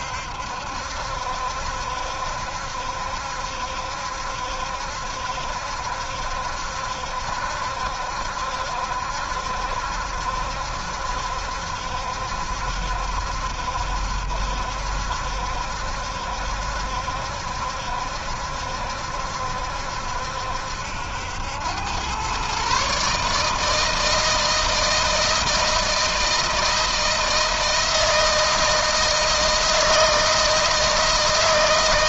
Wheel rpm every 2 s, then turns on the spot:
70, 70, 70, 70, 70, 70, 70, 70, 70, 70, 70, 130, 160, 160, 160, 160.
none